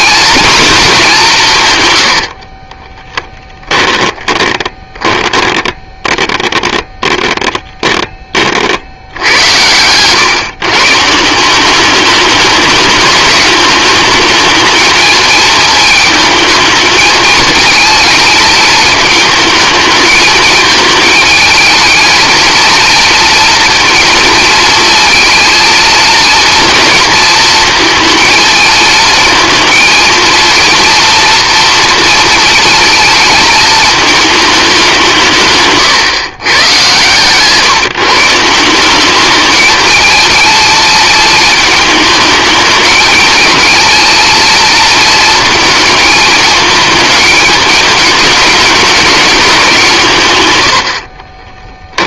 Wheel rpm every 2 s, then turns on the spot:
200, 20, 10, 10, 60, 140, 210, 220, 210, 220, 220, 240, 230, 230, 220, 230, 220, 190, 120, 190, 220, 220, 220, 220, 200, 80.
2-6